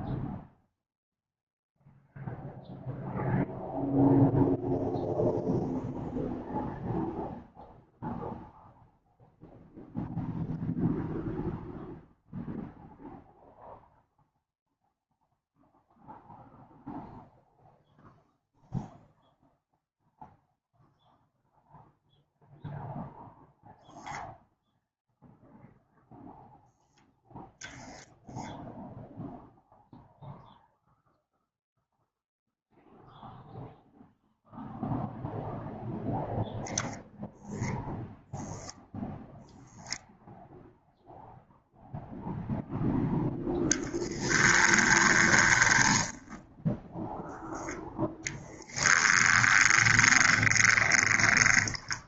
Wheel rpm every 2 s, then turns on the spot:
0, 0, 0, 0, 0, 0, 0, 0, 0, 0, 0, 0, 0, 0, 0, 0, 0, 0, 0, 0, 0, 0, 20, 0, 10, 20.
44-46 48-52